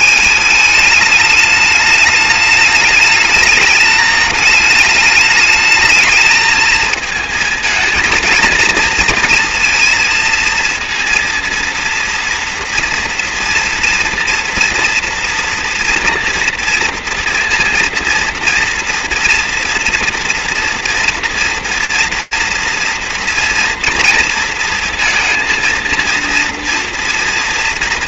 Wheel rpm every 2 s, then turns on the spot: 210, 210, 210, 220, 230, 230, 230, 230, 230, 230, 230, 230, 230, 230.
none